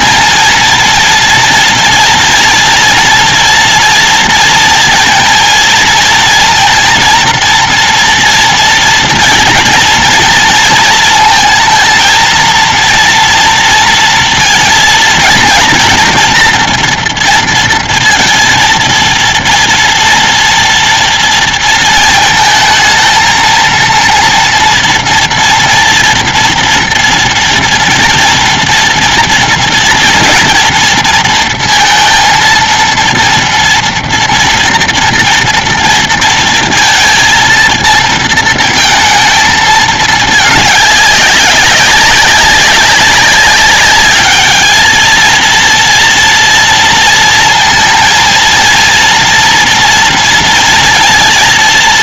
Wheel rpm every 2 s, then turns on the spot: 230, 230, 230, 230, 230, 230, 220, 230, 240, 230, 230, 230, 230, 240, 230, 230, 230, 230, 230, 230, 220, 190, 200, 230, 230, 230.
none